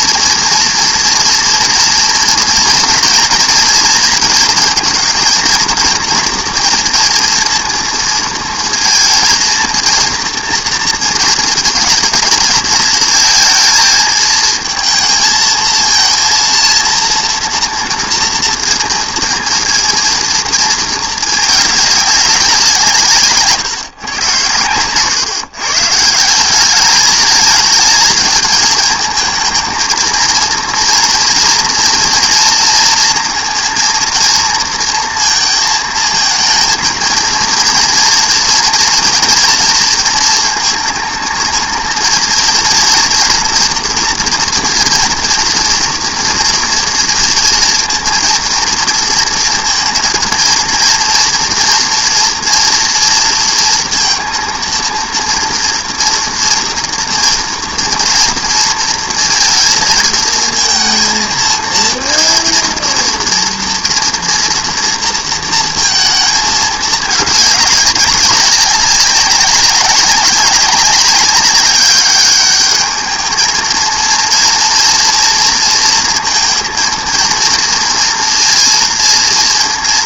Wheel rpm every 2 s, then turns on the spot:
230, 230, 220, 240, 230, 230, 220, 230, 230, 230, 230, 170, 120, 200, 220, 230, 230, 230, 220, 230, 220, 230, 240, 230, 230, 230, 230, 230, 230, 230, 220, 230, 230, 210, 200, 190, 210, 230, 230, 230.
none